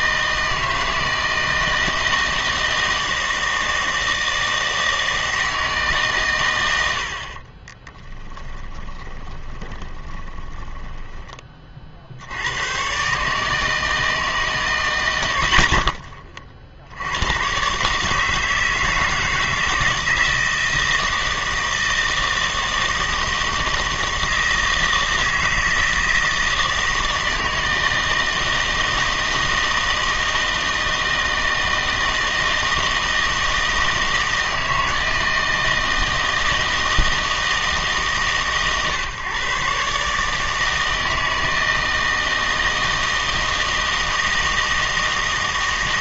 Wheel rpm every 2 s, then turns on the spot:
160, 160, 160, 90, 20, 10, 110, 130, 50, 160, 160, 160, 160, 160, 160, 160, 160, 160, 160, 140, 160, 160, 160.
8-12